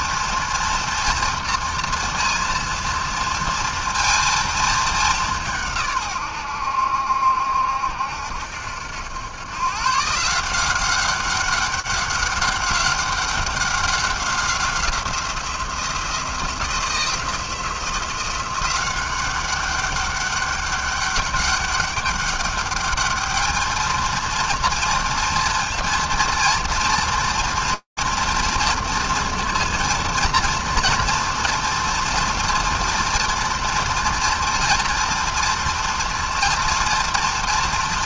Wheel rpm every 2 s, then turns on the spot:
230, 230, 230, 100, 70, 170, 190, 190, 170, 180, 200, 200, 230, 230, 230, 230, 230, 230, 230.
none